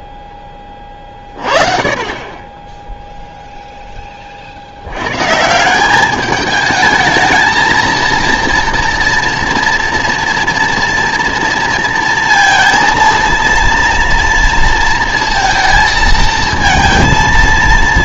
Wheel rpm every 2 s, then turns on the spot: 20, 10, 90, 220, 230, 230, 230, 230, 230.
none